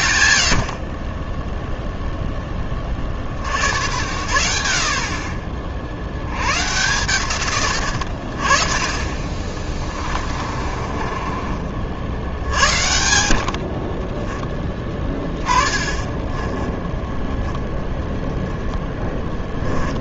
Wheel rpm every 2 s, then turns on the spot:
90, 20, 60, 120, 40, 40, 90, 20, 10, 10.
10-12 16-18